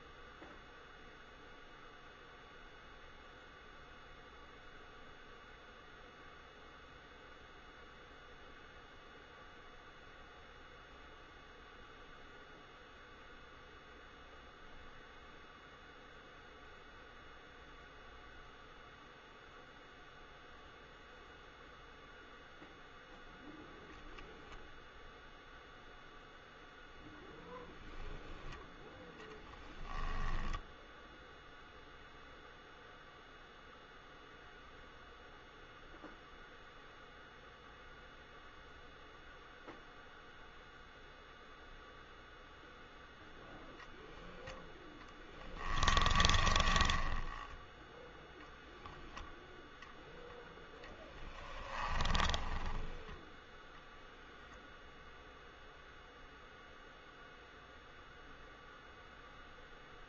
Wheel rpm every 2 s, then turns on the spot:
0, 0, 0, 0, 0, 0, 0, 0, 0, 0, 0, 0, 0, 0, 0, 0, 0, 0, 0, 0, 0, 0, 0, 20, 0, 10, 10, 0, 0, 0.
46-48 50-54